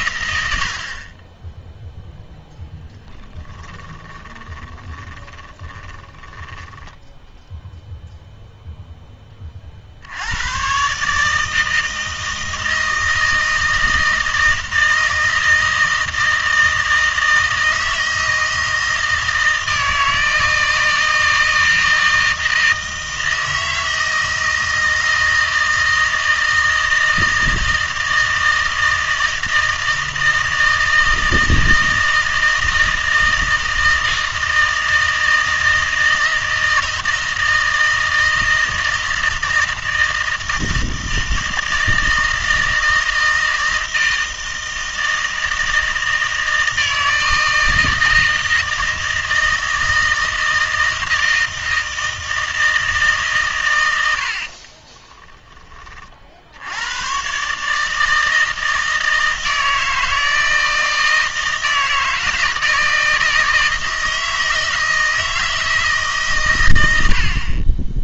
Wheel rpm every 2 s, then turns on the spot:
70, 10, 20, 10, 0, 120, 160, 160, 160, 160, 160, 160, 160, 160, 160, 160, 160, 160, 160, 160, 160, 160, 160, 160, 160, 160, 160, 30, 80, 160, 160, 160, 160, 110.
2-8 54-56